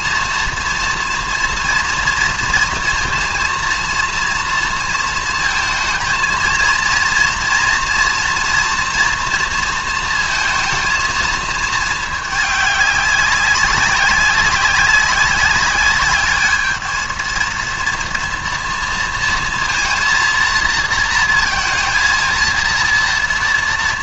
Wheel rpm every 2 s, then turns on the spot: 230, 230, 230, 230, 240, 230, 200, 190, 210, 230, 230, 230.
none